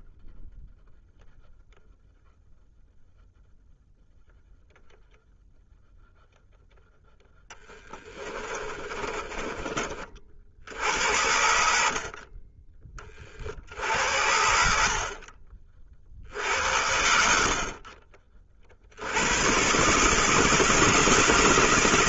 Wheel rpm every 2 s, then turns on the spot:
0, 0, 0, 0, 30, 80, 20, 60, 60, 110, 160.
8-12